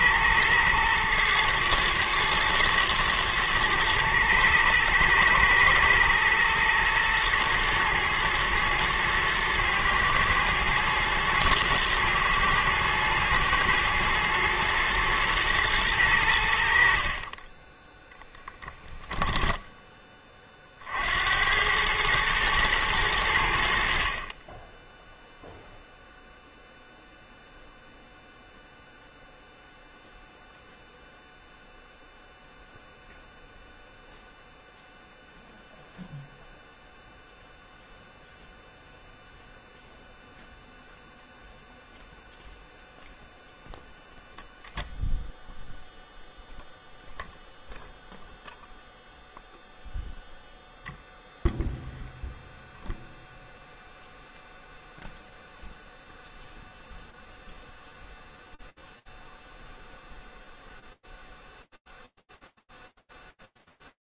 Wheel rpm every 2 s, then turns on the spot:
120, 110, 110, 110, 110, 120, 120, 120, 70, 0, 40, 110, 10, 0, 0, 0, 0, 0, 0, 0, 0, 0, 0, 0, 0, 0, 0, 0, 0, 0, 0, 0.
none